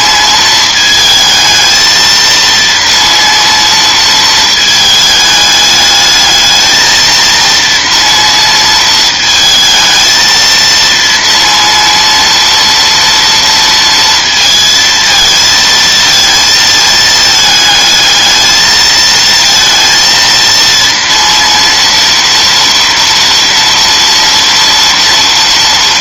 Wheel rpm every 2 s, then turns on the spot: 220, 230, 220, 220, 230, 230, 230, 230, 220, 220, 230, 230, 230.
none